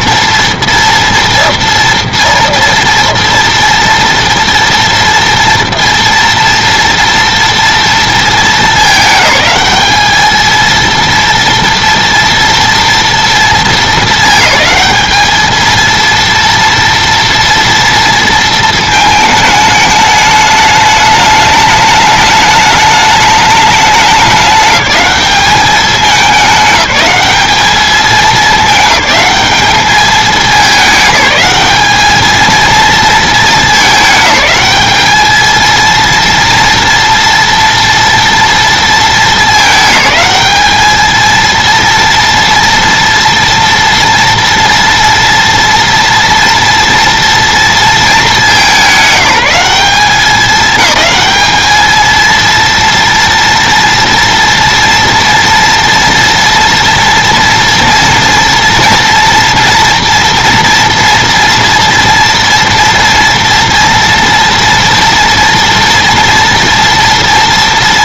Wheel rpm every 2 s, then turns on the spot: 230, 230, 230, 230, 210, 220, 230, 220, 230, 220, 210, 210, 200, 200, 210, 210, 220, 210, 230, 230, 210, 230, 230, 230, 200, 200, 230, 230, 230, 230, 240, 230, 230, 230.
none